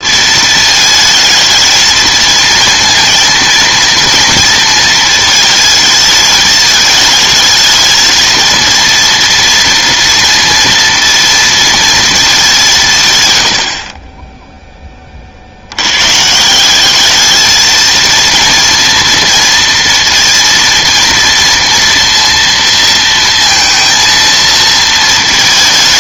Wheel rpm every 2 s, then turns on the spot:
220, 230, 230, 220, 230, 230, 170, 10, 190, 230, 230, 230, 230.
none